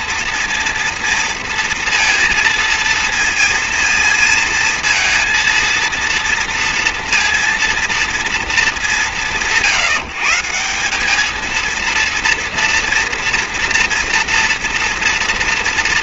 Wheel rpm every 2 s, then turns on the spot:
230, 230, 230, 230, 220, 150, 230, 230.
none